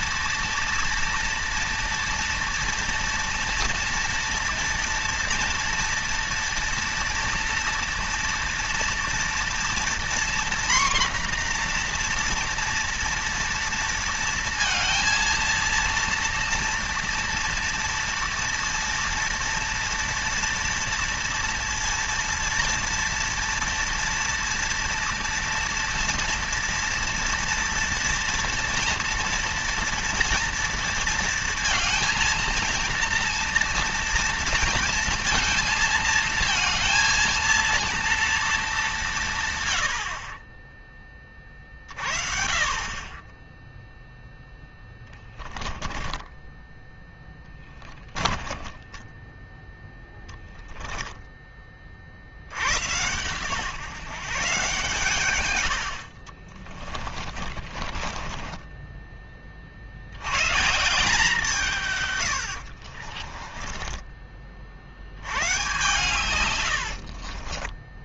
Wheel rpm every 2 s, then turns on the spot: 230, 230, 230, 230, 230, 240, 230, 230, 230, 230, 230, 230, 230, 230, 230, 230, 230, 230, 230, 180, 30, 20, 10, 10, 10, 10, 110, 130, 40, 20, 160, 40, 90, 70.
44-50 56-58 62-64 66-68